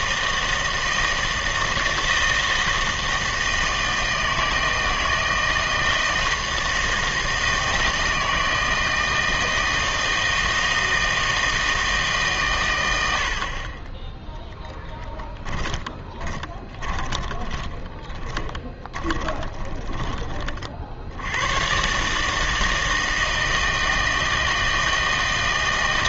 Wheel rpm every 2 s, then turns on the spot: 160, 160, 160, 160, 160, 160, 120, 0, 20, 20, 40, 160, 160.
16-20